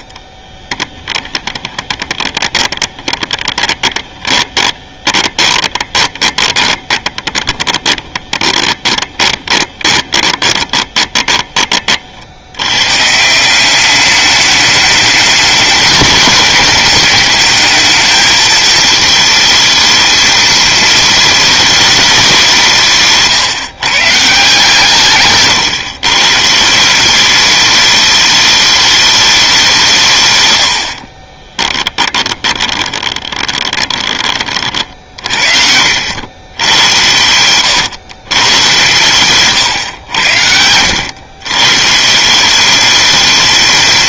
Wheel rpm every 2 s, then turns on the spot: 20, 20, 10, 20, 20, 30, 120, 210, 200, 220, 230, 170, 160, 170, 210, 70, 20, 50, 100, 120, 90, 200.
0-12 30-34